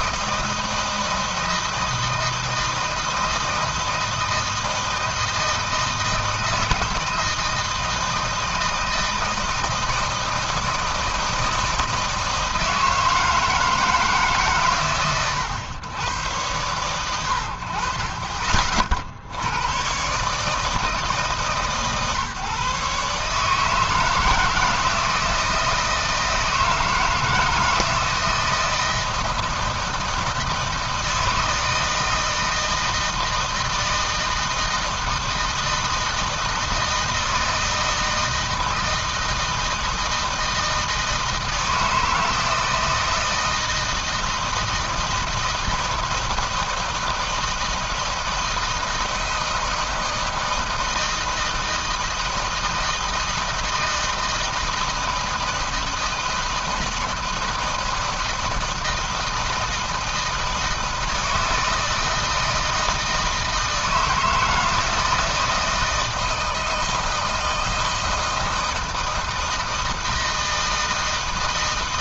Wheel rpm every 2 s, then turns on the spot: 160, 160, 160, 160, 160, 160, 160, 140, 110, 40, 140, 140, 160, 160, 160, 160, 160, 160, 160, 160, 160, 160, 160, 160, 160, 160, 160, 160, 160, 170, 160, 160, 160, 160, 160, 160.
none